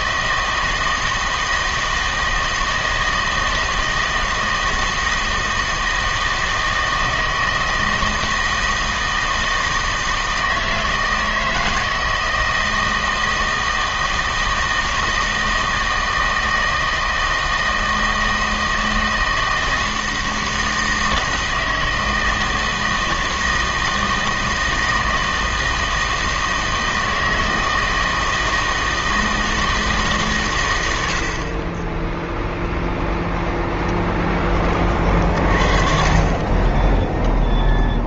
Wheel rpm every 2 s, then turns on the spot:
160, 160, 160, 160, 160, 160, 160, 160, 160, 160, 160, 160, 160, 160, 160, 110, 0, 20, 20.
none